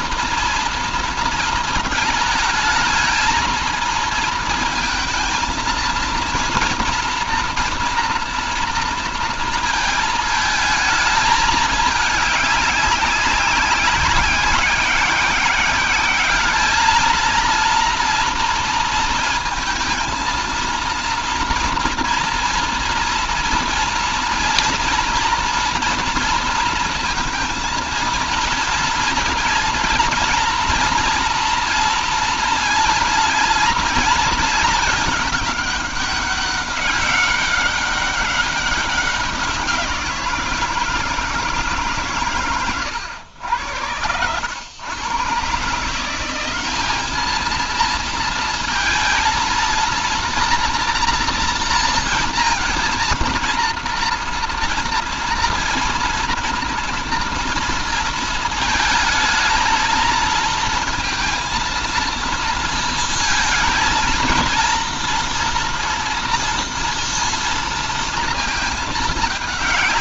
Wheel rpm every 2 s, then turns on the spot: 230, 220, 230, 240, 240, 220, 200, 190, 210, 230, 230, 230, 240, 230, 230, 230, 230, 220, 190, 200, 170, 110, 110, 200, 230, 230, 230, 230, 240, 220, 230, 230, 230, 230, 220.
none